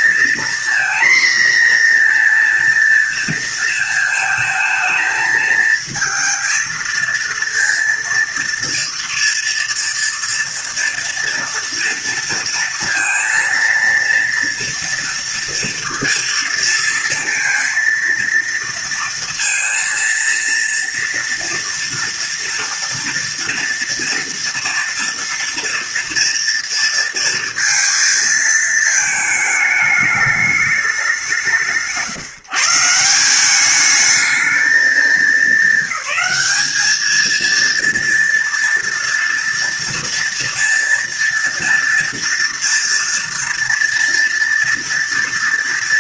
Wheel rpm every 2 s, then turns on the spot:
240, 240, 220, 220, 230, 230, 230, 230, 230, 230, 230, 230, 230, 230, 220, 210, 150, 220, 210, 230, 230, 240, 230.
none